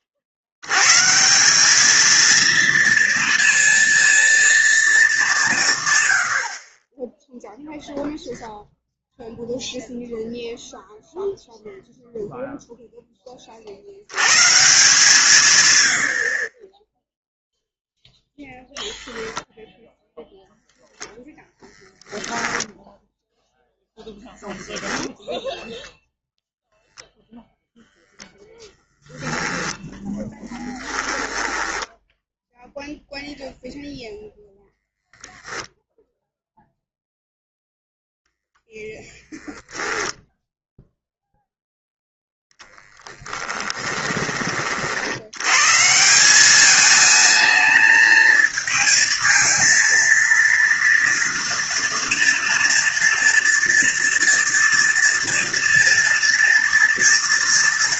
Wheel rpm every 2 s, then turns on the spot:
70, 230, 230, 50, 0, 0, 0, 150, 20, 0, 0, 0, 0, 0, 0, 10, 0, 0, 0, 0, 0, 10, 40, 210, 220, 230, 230, 230, 230.
30-32 42-44